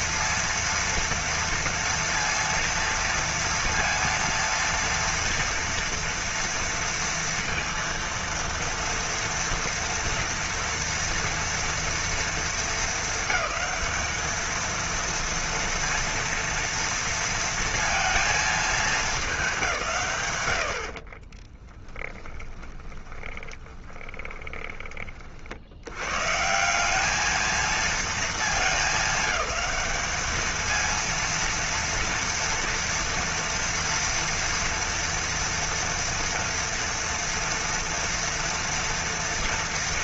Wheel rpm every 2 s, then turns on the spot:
230, 230, 230, 230, 230, 240, 230, 220, 230, 220, 110, 10, 20, 150, 220, 220, 230, 240, 230, 230.
22-26